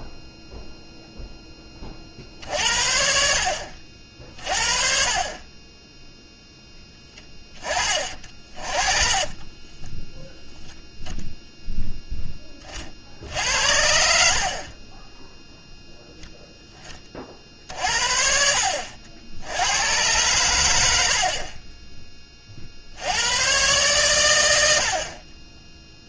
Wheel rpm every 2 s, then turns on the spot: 0, 60, 40, 10, 40, 0, 20, 50, 0, 60, 110, 30, 120.
none